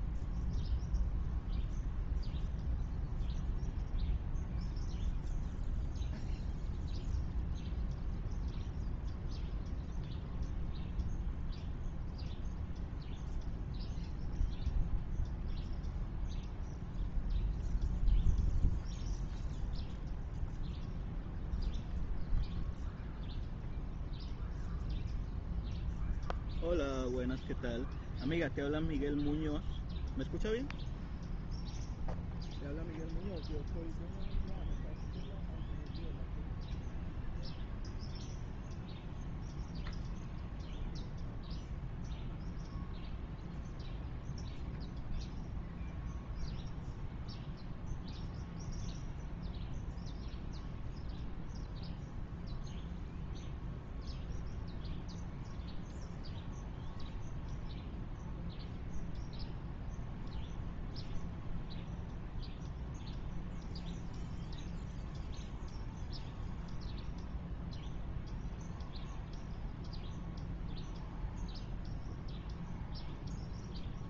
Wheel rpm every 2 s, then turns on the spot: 0, 0, 0, 0, 0, 0, 0, 0, 0, 0, 0, 0, 0, 0, 0, 0, 0, 0, 0, 0, 0, 0, 0, 0, 0, 0, 0, 0, 0, 0, 0, 0, 0, 0, 0, 0, 0.
none